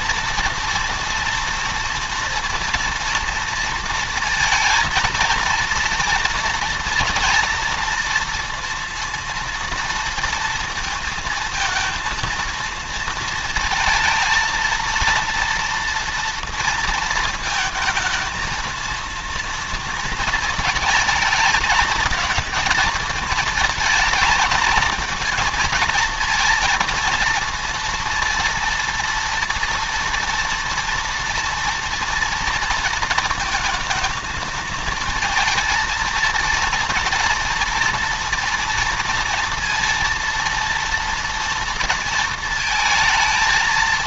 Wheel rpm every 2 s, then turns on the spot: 230, 230, 220, 230, 230, 230, 230, 230, 230, 230, 230, 230, 230, 230, 230, 230, 230, 220, 230, 240, 230, 220.
none